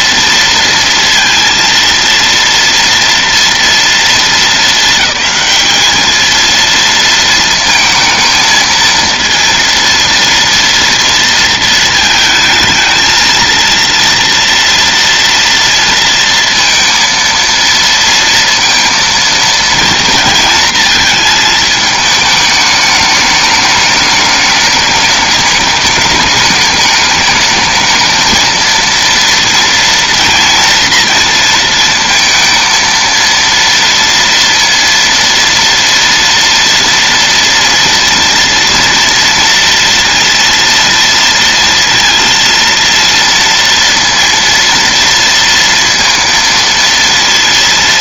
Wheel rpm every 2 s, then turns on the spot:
230, 230, 220, 230, 230, 230, 220, 230, 220, 230, 230, 210, 210, 210, 230, 230, 230, 230, 230, 230, 230, 230, 230, 230.
none